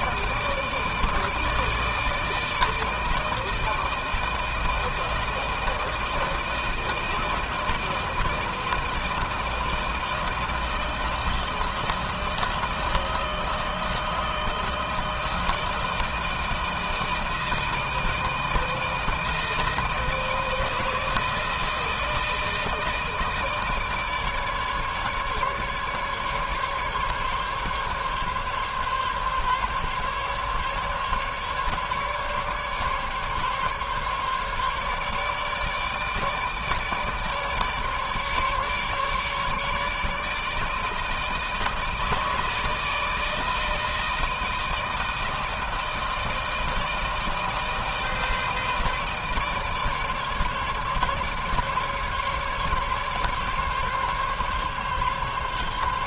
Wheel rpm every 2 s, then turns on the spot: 160, 160, 160, 160, 160, 160, 160, 160, 160, 160, 160, 160, 150, 150, 140, 150, 140, 150, 150, 150, 150, 160, 160, 160, 160, 150, 140, 140.
none